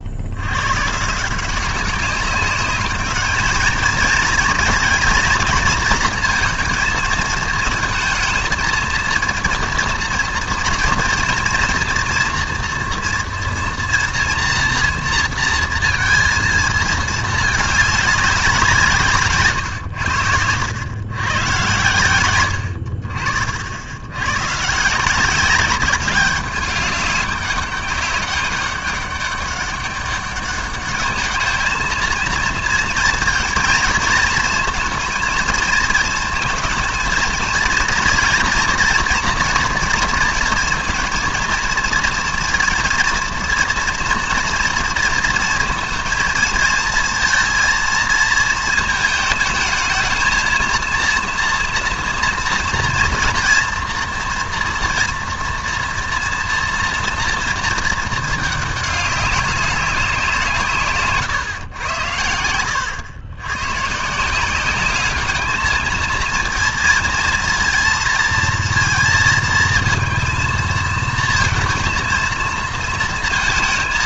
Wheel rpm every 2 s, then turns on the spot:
110, 200, 230, 230, 220, 230, 230, 230, 220, 180, 90, 80, 140, 200, 200, 200, 230, 230, 220, 230, 230, 230, 230, 220, 220, 230, 230, 230, 240, 210, 160, 100, 190, 230, 230, 220, 230.
62-64